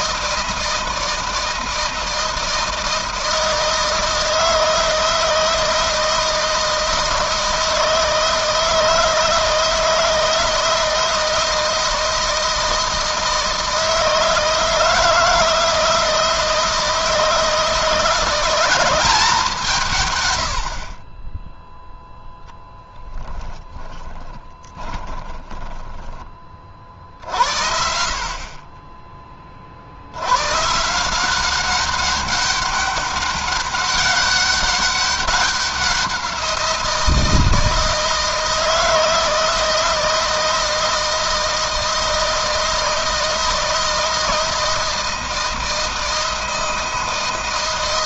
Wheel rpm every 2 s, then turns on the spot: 160, 160, 160, 160, 160, 160, 160, 160, 160, 190, 50, 10, 20, 50, 40, 140, 200, 190, 170, 160, 160, 160, 160, 160.
22-26